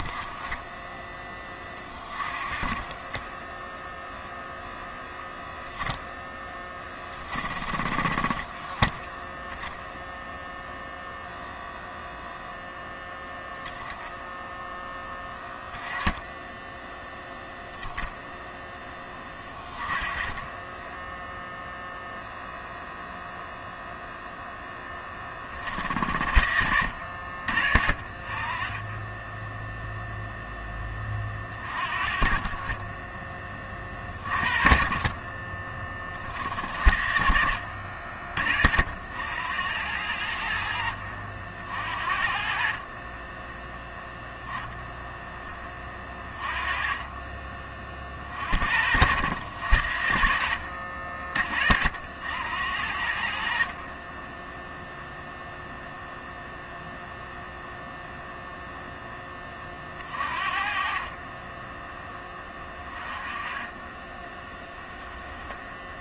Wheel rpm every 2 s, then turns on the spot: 10, 20, 0, 20, 20, 0, 0, 10, 10, 20, 10, 0, 10, 70, 20, 10, 30, 30, 60, 60, 70, 50, 0, 20, 70, 60, 70, 0, 0, 0, 40, 20, 10.
none